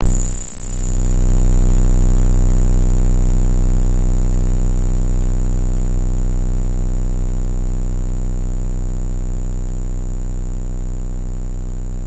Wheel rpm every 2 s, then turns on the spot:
0, 0, 0, 0, 0, 0.
none